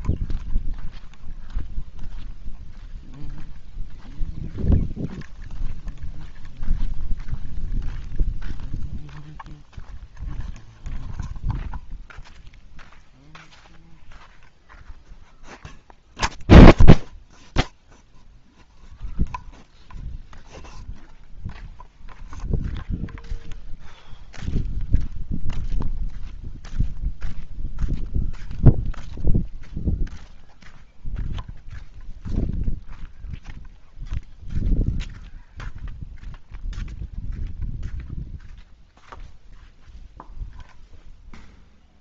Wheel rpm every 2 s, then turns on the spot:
0, 0, 0, 0, 0, 0, 0, 0, 0, 0, 0, 0, 0, 0, 0, 0, 0, 0, 0, 0, 0.
none